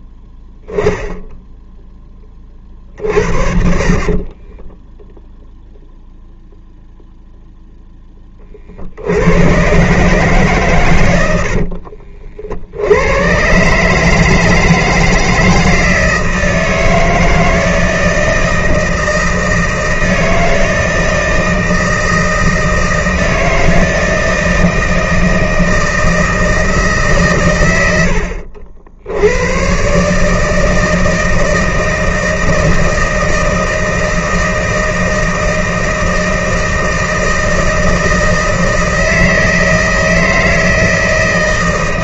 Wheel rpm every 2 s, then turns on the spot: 0, 40, 20, 0, 40, 130, 80, 160, 160, 160, 160, 160, 160, 160, 70, 160, 160, 160, 160, 160, 160.
4-6